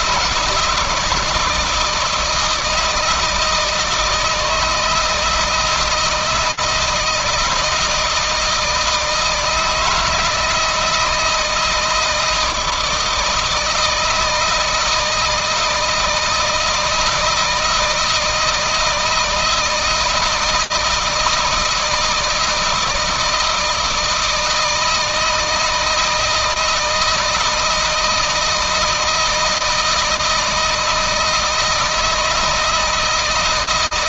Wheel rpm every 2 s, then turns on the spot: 160, 160, 160, 160, 170, 160, 160, 160, 160, 160, 160, 160, 160, 160, 160, 160, 160.
none